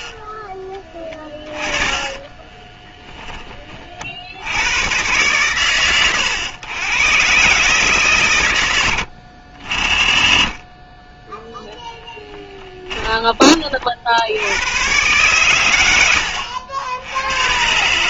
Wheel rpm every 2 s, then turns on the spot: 10, 20, 90, 110, 100, 20, 10, 100, 80.
2-4 12-14